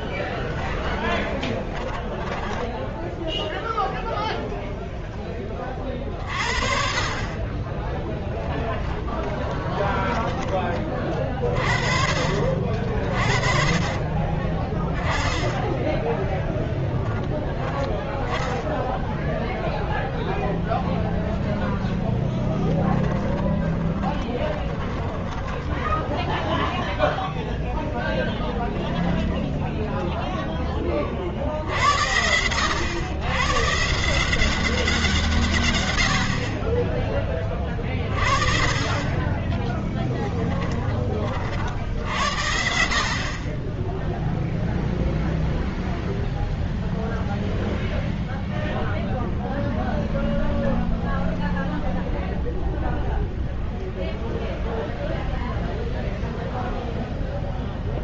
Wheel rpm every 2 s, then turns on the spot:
20, 10, 0, 50, 20, 20, 40, 20, 10, 0, 0, 10, 10, 0, 10, 20, 90, 180, 40, 30, 20, 50, 0, 0, 0, 0, 0, 0, 0.
0-4 8-10 22-26